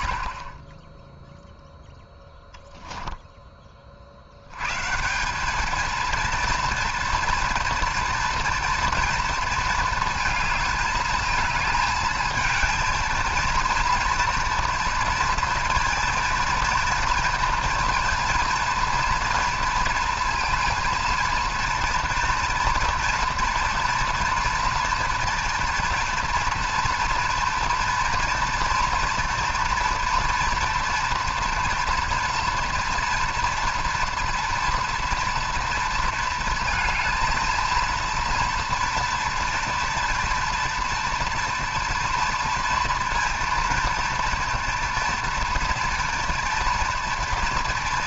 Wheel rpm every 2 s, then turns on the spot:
20, 10, 140, 230, 230, 220, 220, 230, 230, 230, 230, 230, 230, 230, 230, 230, 230, 240, 230, 230, 230, 230, 230, 230.
2-4